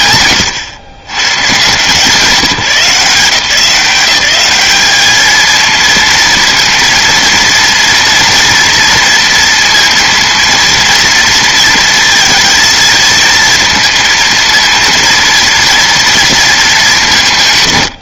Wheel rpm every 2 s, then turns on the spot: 130, 170, 210, 230, 230, 230, 230, 230, 200.
none